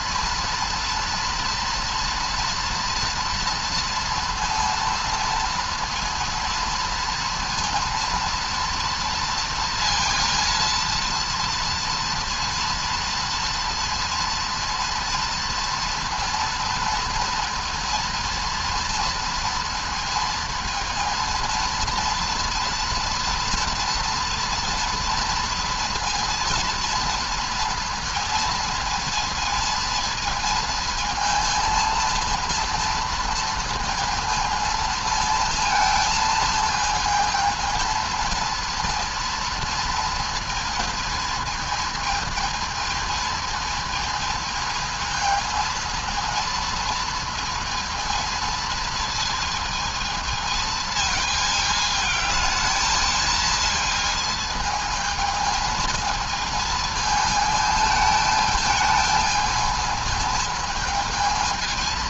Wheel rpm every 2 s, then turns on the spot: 230, 230, 230, 230, 230, 230, 230, 230, 230, 230, 230, 230, 240, 230, 230, 220, 230, 230, 220, 230, 230, 220, 220, 230, 230, 220, 220, 220, 220, 220, 220.
none